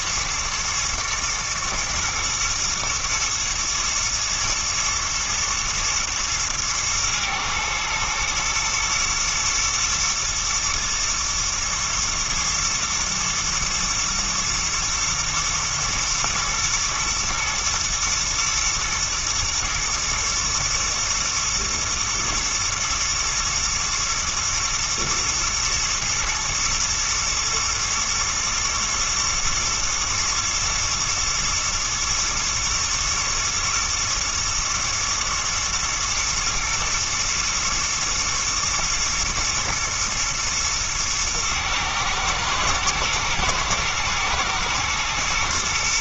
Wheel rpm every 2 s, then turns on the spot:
110, 120, 110, 110, 120, 110, 110, 120, 120, 110, 110, 120, 110, 110, 110, 110, 110, 120, 120, 110, 110, 110, 110.
none